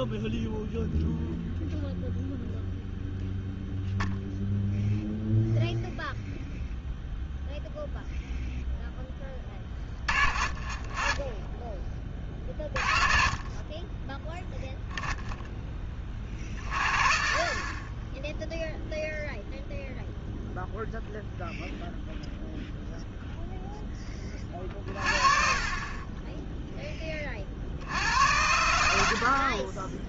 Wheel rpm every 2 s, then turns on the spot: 0, 0, 0, 0, 0, 30, 30, 0, 40, 0, 0, 0, 30, 10, 110.
none